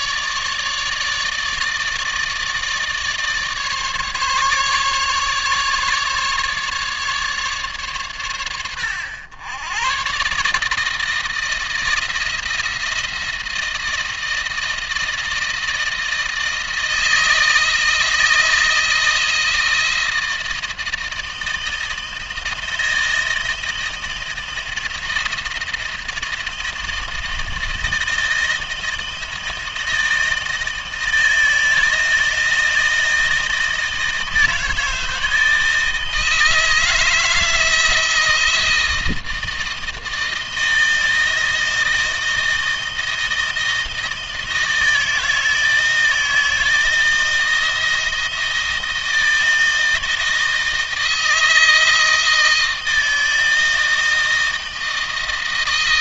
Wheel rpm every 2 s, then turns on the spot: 150, 150, 140, 150, 90, 150, 170, 160, 160, 160, 160, 160, 160, 160, 160, 160, 160, 160, 160, 170, 160, 160, 160, 160, 160, 160, 160, 160.
none